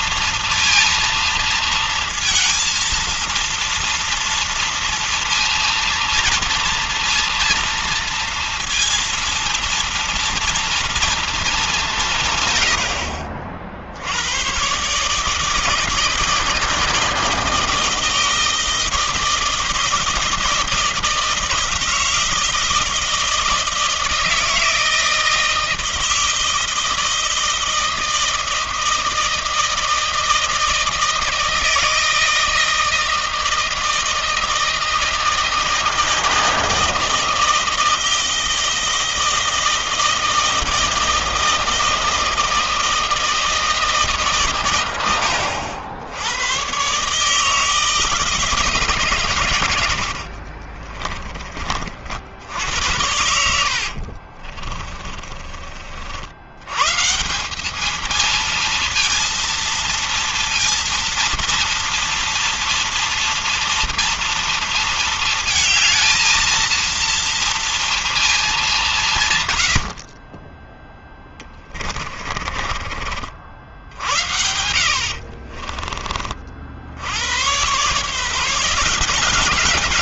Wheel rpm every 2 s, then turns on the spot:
230, 220, 230, 230, 230, 230, 120, 100, 160, 160, 160, 160, 160, 160, 160, 160, 160, 160, 160, 160, 160, 160, 130, 90, 160, 60, 70, 50, 80, 230, 230, 230, 230, 230, 220, 40, 40, 70, 50, 160.
50-52 54-56 72-74